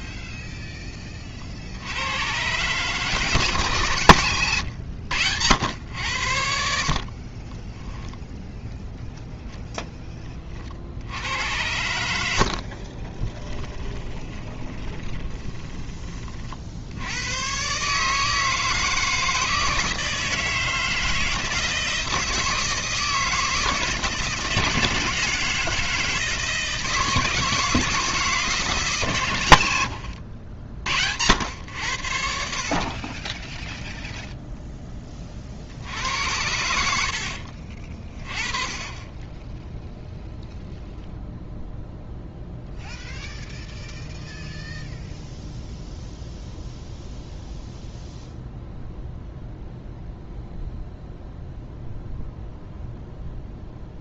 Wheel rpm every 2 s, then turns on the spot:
10, 150, 120, 60, 0, 60, 40, 20, 70, 160, 160, 160, 160, 160, 150, 70, 40, 10, 70, 30, 0, 0, 0, 0, 0, 0, 0.
4-8 12-16